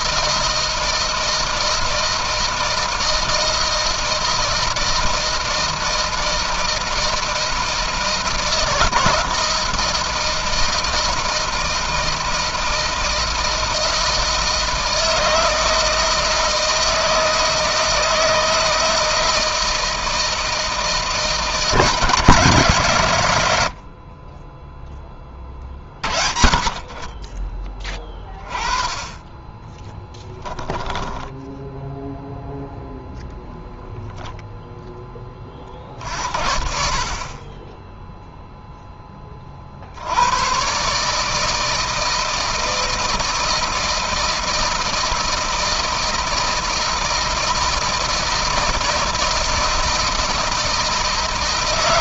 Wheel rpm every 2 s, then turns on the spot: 160, 160, 160, 160, 160, 160, 160, 160, 160, 160, 160, 120, 20, 20, 20, 10, 0, 10, 50, 10, 140, 160, 160, 160, 160, 160.
30-32